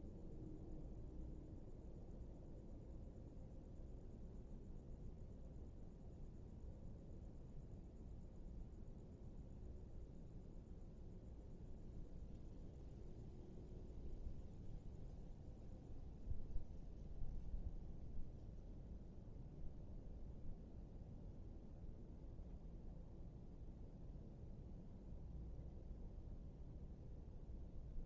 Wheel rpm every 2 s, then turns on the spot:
0, 0, 0, 0, 0, 0, 0, 0, 0, 0, 0, 0, 0, 0.
none